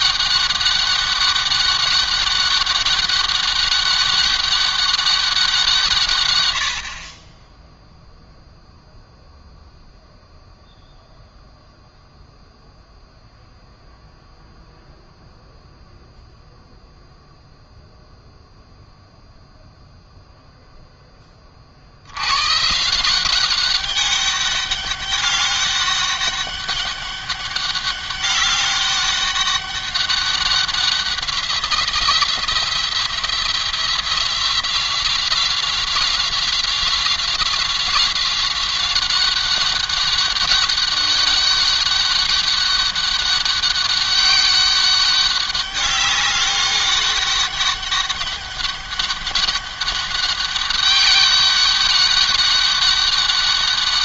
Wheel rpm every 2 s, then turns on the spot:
200, 200, 200, 70, 0, 0, 0, 0, 0, 0, 0, 140, 200, 200, 200, 190, 170, 180, 180, 190, 200, 200, 200, 200, 200, 200, 200.
none